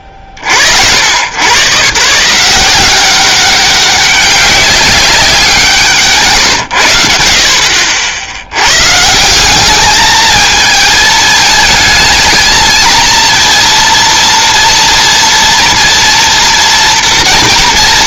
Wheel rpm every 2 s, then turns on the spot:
70, 180, 190, 130, 80, 220, 230, 230, 230.
none